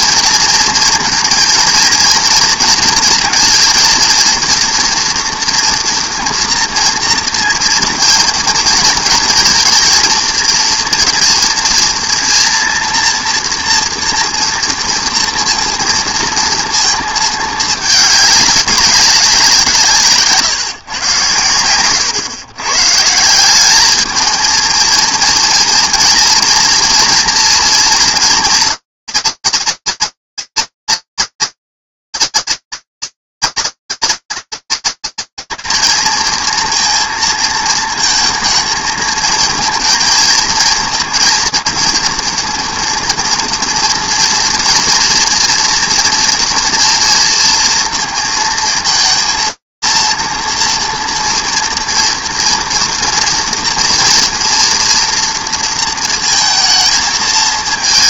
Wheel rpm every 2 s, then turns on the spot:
230, 230, 230, 230, 230, 230, 230, 230, 230, 200, 150, 140, 220, 240, 230, 230, 230, 220, 240, 230, 240, 240, 240, 230, 230, 230, 230, 230, 230.
none